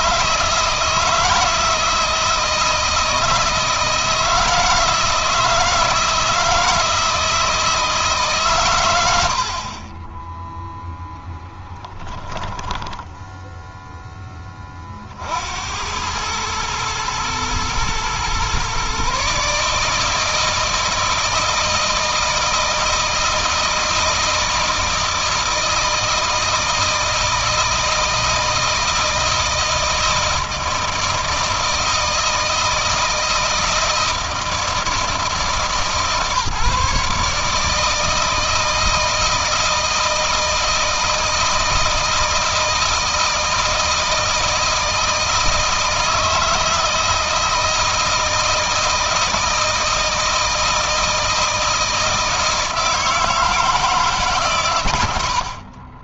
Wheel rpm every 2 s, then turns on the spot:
160, 160, 160, 160, 90, 0, 10, 40, 110, 140, 160, 160, 160, 160, 160, 160, 160, 160, 150, 160, 160, 160, 160, 160, 160, 160, 160, 110.
12-14